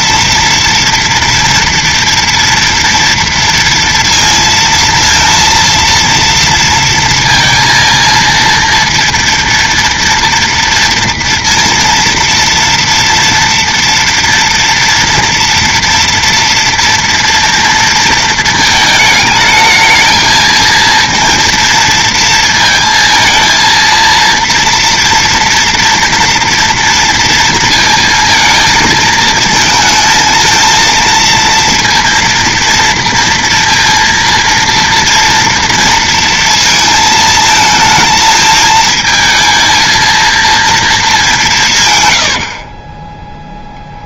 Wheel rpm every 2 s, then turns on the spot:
230, 230, 230, 230, 230, 230, 230, 230, 230, 220, 230, 230, 230, 230, 220, 220, 230, 230, 220, 220, 220, 30.
42-44